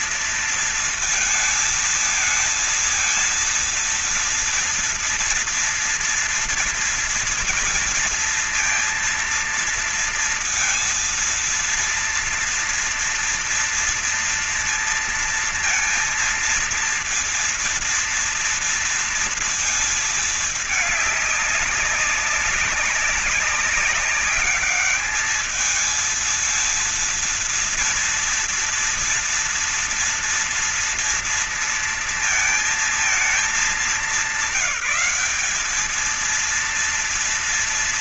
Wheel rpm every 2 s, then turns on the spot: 230, 220, 230, 230, 230, 230, 230, 230, 230, 230, 220, 200, 200, 230, 230, 230, 230, 190, 230.
none